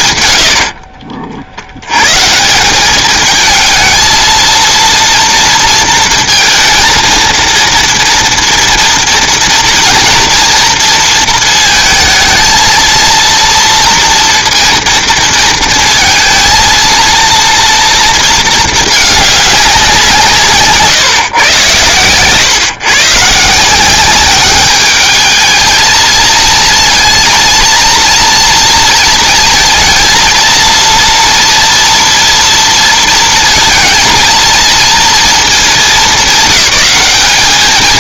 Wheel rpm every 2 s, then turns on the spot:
70, 180, 230, 230, 230, 230, 230, 230, 230, 220, 150, 140, 200, 230, 230, 230, 230, 230, 200.
0-2